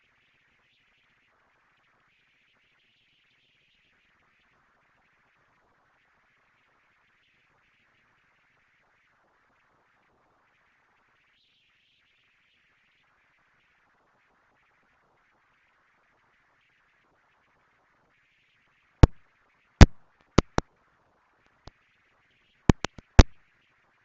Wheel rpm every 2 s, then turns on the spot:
210, 230, 230, 230, 220, 230, 230, 230, 240, 210, 220, 250.
none